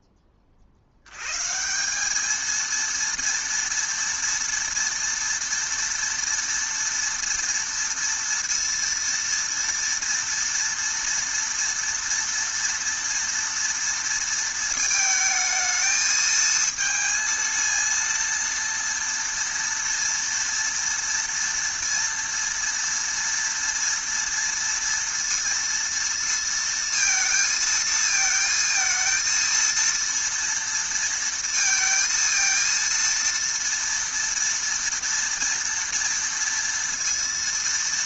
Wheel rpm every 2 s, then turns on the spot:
40, 220, 230, 230, 230, 230, 230, 220, 220, 230, 230, 230, 230, 230, 220, 230, 230, 230, 230.
none